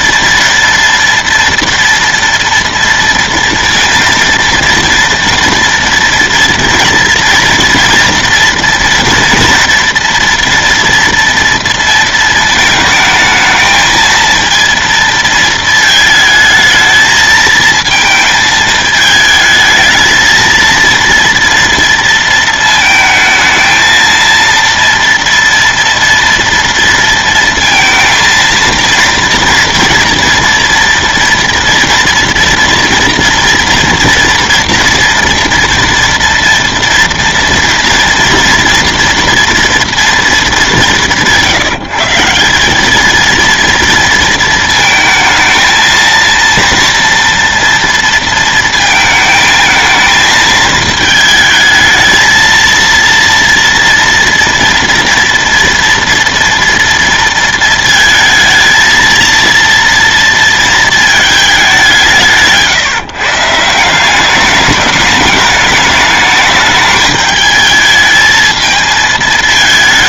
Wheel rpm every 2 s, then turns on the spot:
230, 230, 230, 230, 230, 230, 220, 230, 220, 220, 230, 220, 230, 230, 230, 240, 240, 230, 240, 230, 180, 200, 220, 230, 220, 220, 230, 230, 230, 220, 220, 150, 210, 210, 220.
none